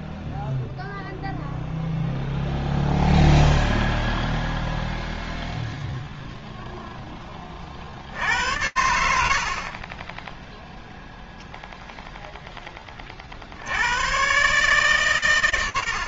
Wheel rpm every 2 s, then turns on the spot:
0, 0, 0, 90, 0, 10, 140, 30.
none